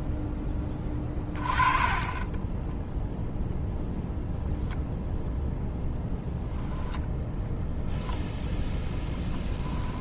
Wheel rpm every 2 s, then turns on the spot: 20, 10, 0, 10, 10.
0-4